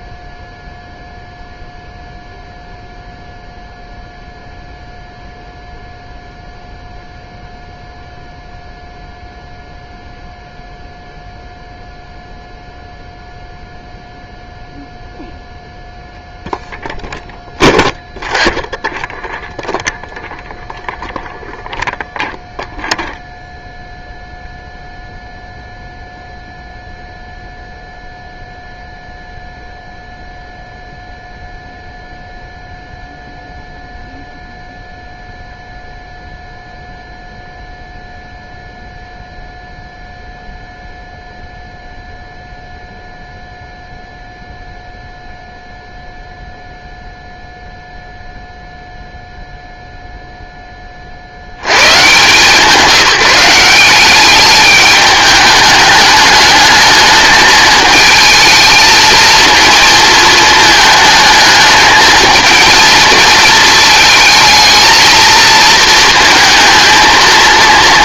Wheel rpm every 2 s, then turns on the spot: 0, 0, 0, 0, 0, 0, 0, 0, 0, 0, 0, 0, 0, 0, 0, 0, 0, 0, 0, 0, 0, 0, 0, 0, 0, 20, 180, 210, 210, 220, 220, 230, 220, 220.
none